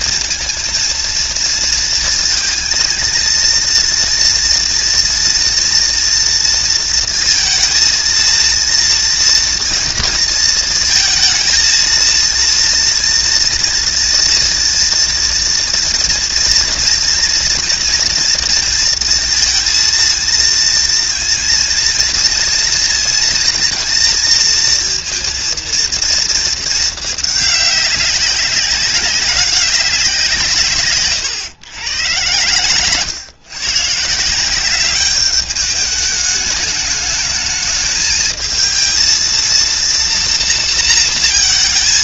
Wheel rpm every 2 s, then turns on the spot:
230, 230, 230, 230, 230, 230, 230, 240, 230, 230, 230, 230, 230, 220, 200, 150, 120, 190, 210, 220, 230.
none